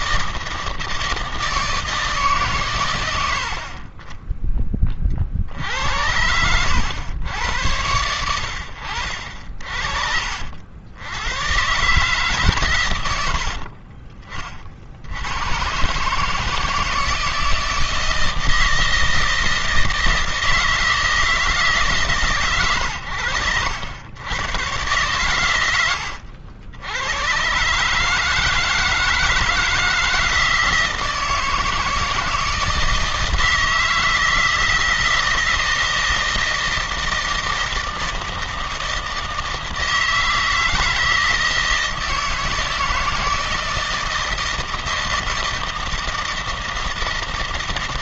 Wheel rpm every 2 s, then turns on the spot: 160, 140, 20, 90, 80, 70, 130, 40, 150, 160, 160, 120, 110, 80, 150, 160, 160, 160, 160, 160, 160, 160, 160, 160.
none